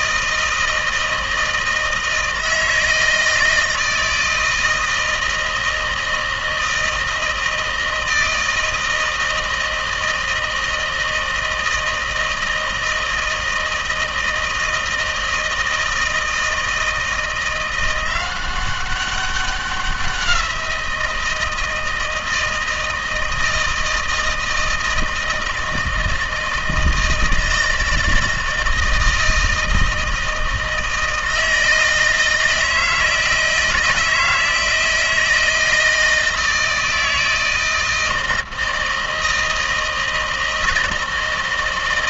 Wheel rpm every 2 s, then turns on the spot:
160, 160, 160, 160, 160, 160, 160, 160, 160, 190, 180, 160, 160, 160, 160, 160, 160, 160, 160, 160, 160.
none